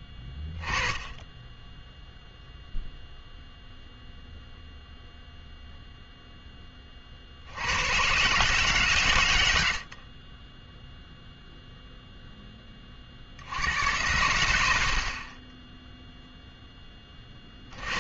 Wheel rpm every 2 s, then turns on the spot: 0, 0, 0, 90, 80, 0, 70, 30, 20.
none